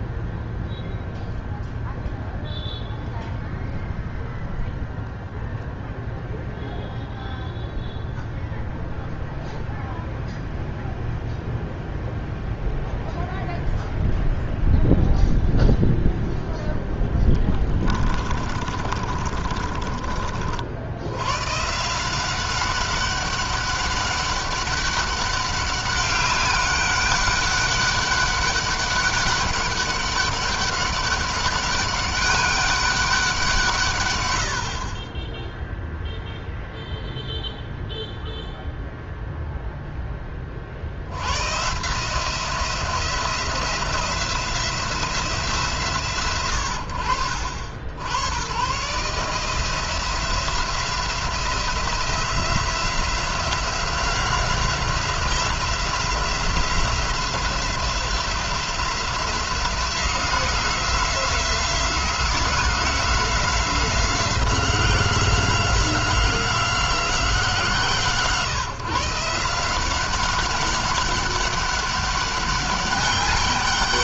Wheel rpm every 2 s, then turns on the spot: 0, 0, 0, 0, 0, 0, 0, 0, 0, 30, 60, 190, 200, 200, 200, 200, 200, 80, 0, 0, 40, 170, 170, 90, 110, 170, 180, 180, 180, 180, 180, 180, 180, 180, 150, 190, 200.
18-20